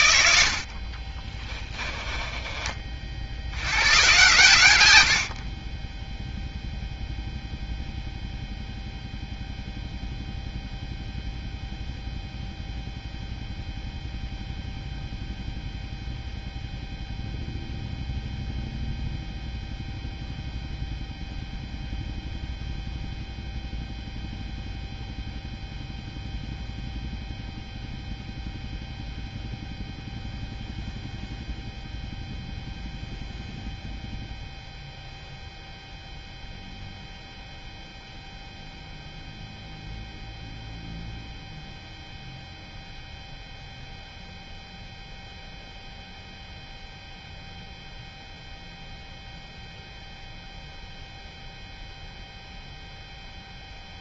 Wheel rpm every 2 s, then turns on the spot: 70, 20, 120, 0, 0, 0, 0, 0, 0, 0, 0, 0, 0, 0, 0, 0, 0, 0, 0, 0, 0, 0, 0, 0, 0, 0, 0.
2-4